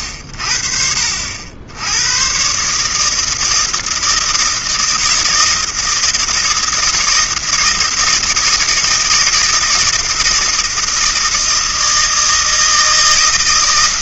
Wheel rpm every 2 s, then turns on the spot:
50, 130, 160, 160, 160, 160, 160.
none